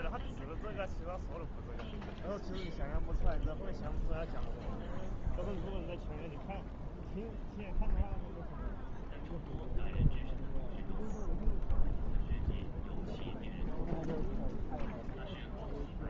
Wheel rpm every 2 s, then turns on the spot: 0, 0, 0, 0, 0, 0, 0, 0.
none